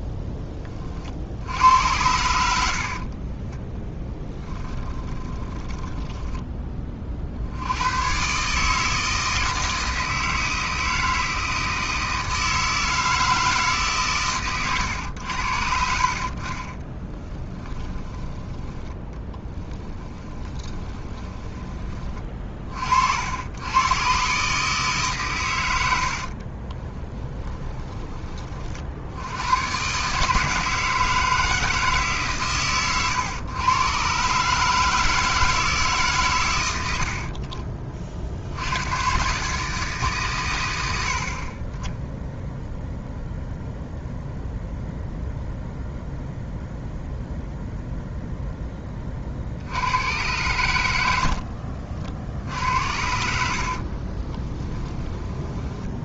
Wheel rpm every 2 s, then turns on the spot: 30, 60, 20, 30, 160, 160, 160, 110, 20, 10, 20, 40, 150, 20, 50, 160, 130, 160, 90, 100, 90, 0, 0, 0, 10, 90, 70, 20.
2-6 16-22 26-28 52-56